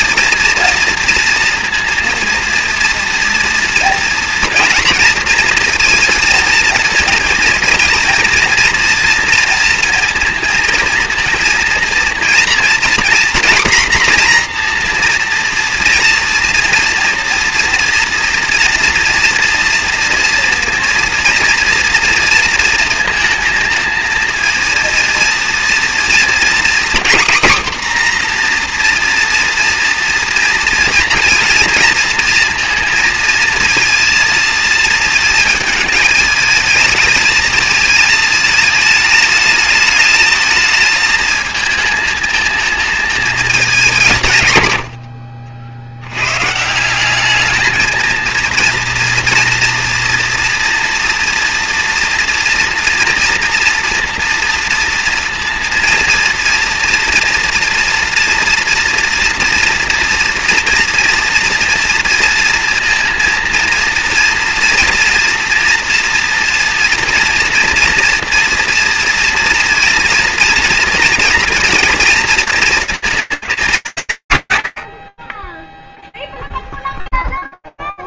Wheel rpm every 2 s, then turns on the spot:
230, 230, 240, 230, 240, 230, 240, 250, 230, 230, 230, 230, 230, 230, 250, 230, 230, 230, 220, 220, 220, 230, 140, 130, 230, 240, 230, 230, 230, 230, 230, 230, 230, 230, 230, 230, 220, 130, 0.
none